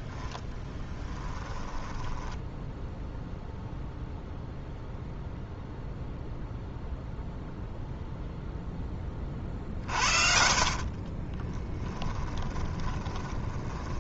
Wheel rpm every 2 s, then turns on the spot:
20, 0, 0, 0, 10, 40, 20.
0-2 10-14